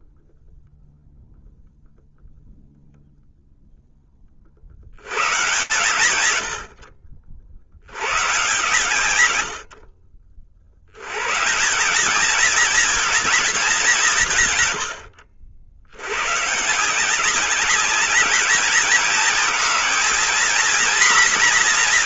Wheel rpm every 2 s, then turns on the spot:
0, 0, 60, 80, 100, 110, 230, 90, 190, 220, 240.
none